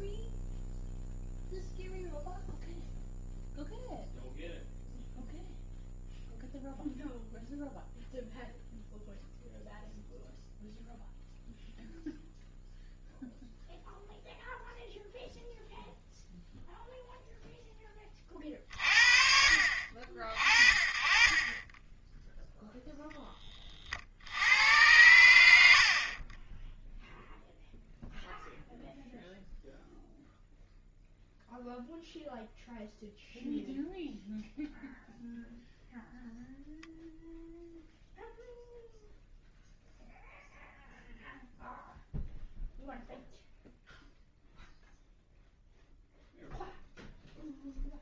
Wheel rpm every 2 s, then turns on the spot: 0, 0, 0, 0, 0, 0, 0, 0, 0, 40, 40, 0, 90, 20, 0, 0, 0, 0, 0, 0, 0, 0, 0, 0.
none